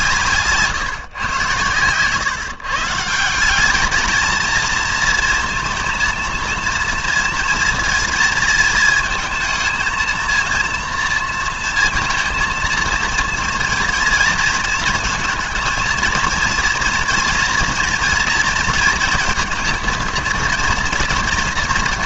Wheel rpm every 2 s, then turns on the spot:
150, 150, 230, 230, 220, 230, 230, 230, 230, 230, 230.
none